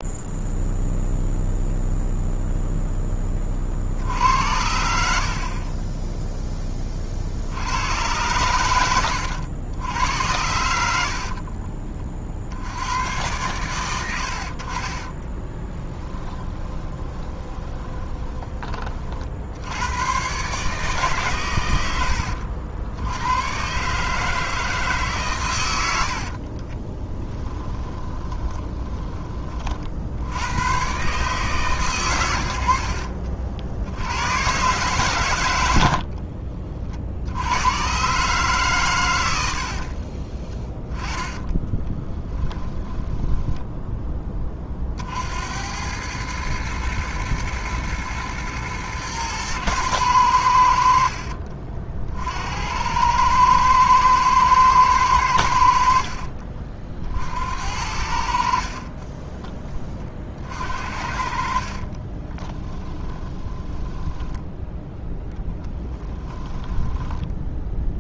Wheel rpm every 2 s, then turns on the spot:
0, 0, 70, 30, 100, 80, 90, 50, 10, 40, 140, 70, 150, 30, 20, 110, 70, 120, 40, 140, 20, 10, 40, 110, 120, 80, 80, 110, 50, 40, 50, 20, 10, 10.
10-12 16-18 26-30 40-44 62-64 66-68